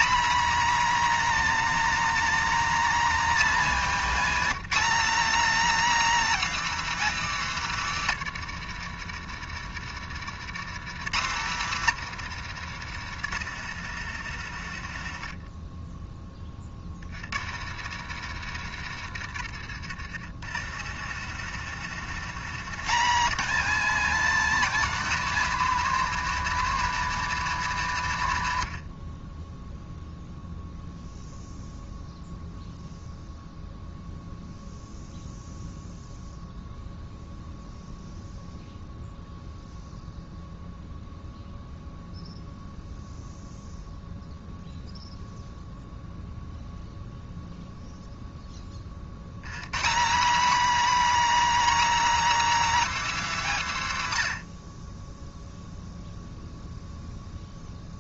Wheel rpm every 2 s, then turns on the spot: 270, 280, 270, 260, 100, 140, 110, 80, 40, 80, 100, 180, 250, 230, 80, 0, 0, 0, 0, 0, 0, 0, 0, 0, 40, 260, 270, 30, 0.
8-22